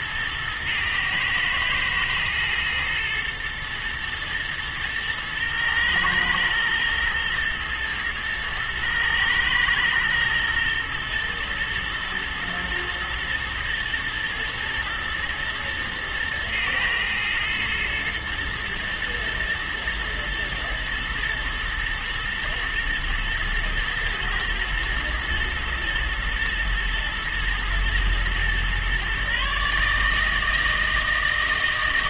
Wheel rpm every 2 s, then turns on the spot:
110, 110, 110, 110, 110, 110, 120, 110, 110, 110, 110, 120, 110, 120, 130, 160.
none